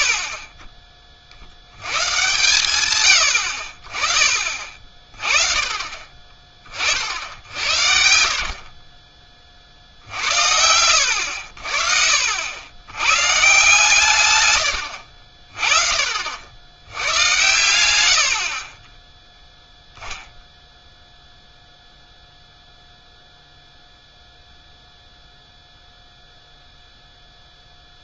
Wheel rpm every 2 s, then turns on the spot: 30, 110, 30, 30, 40, 90, 90, 100, 90, 30, 0, 0, 0, 0.
none